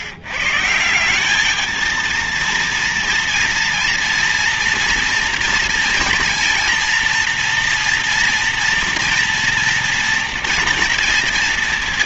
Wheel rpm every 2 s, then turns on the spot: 120, 230, 230, 230, 230, 230.
none